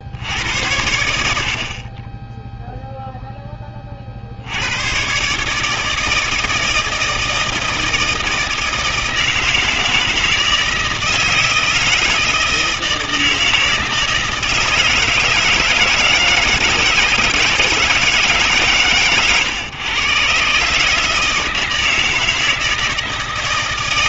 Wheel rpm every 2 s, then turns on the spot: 90, 0, 110, 160, 160, 160, 160, 160, 160, 120, 150, 160.
none